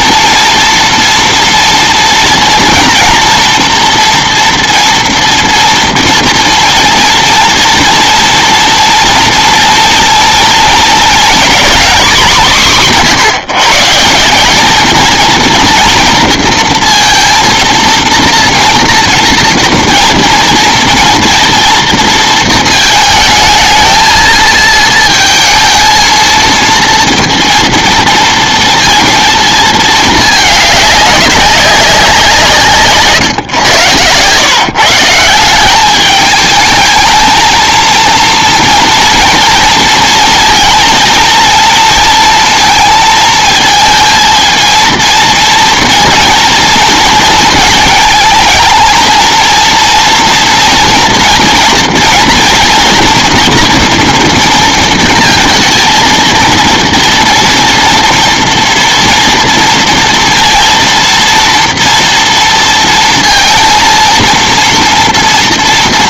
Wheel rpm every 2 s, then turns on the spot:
230, 230, 240, 230, 230, 230, 180, 220, 230, 230, 230, 220, 230, 230, 230, 200, 150, 160, 210, 230, 230, 220, 230, 230, 220, 230, 240, 230, 230, 230, 230, 230, 230.
none